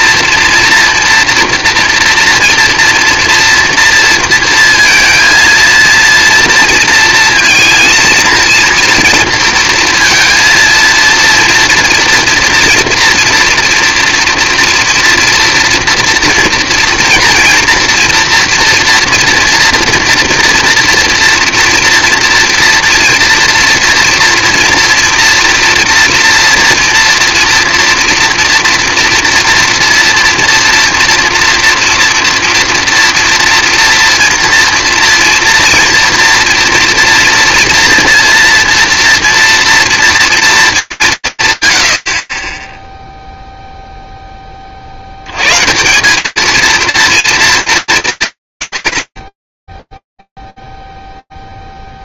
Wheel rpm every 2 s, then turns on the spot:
230, 230, 230, 230, 230, 240, 230, 230, 230, 240, 230, 230, 230, 230, 230, 230, 230, 230, 240, 230, 120, 0, 70, 230, 120, 0.
none